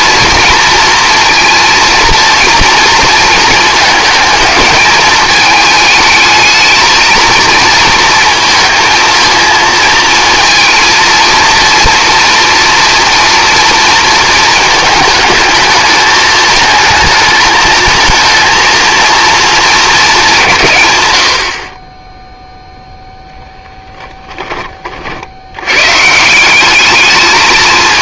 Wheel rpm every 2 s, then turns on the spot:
230, 230, 220, 220, 230, 230, 240, 220, 220, 230, 150, 0, 40, 200.
none